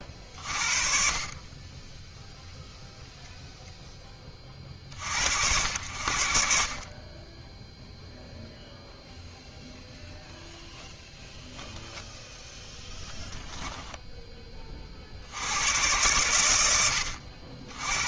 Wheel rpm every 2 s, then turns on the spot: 40, 0, 30, 50, 0, 0, 0, 30, 90.
none